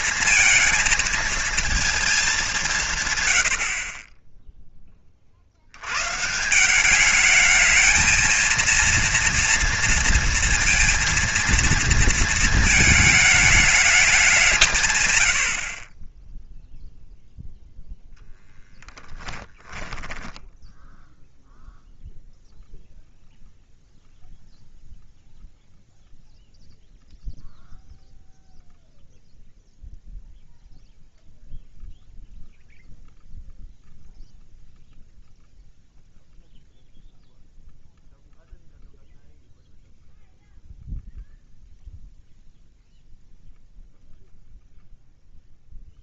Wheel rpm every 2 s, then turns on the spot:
220, 160, 20, 190, 230, 230, 220, 150, 0, 10, 0, 0, 0, 0, 0, 0, 0, 0, 0, 0, 0, 0, 0.
18-20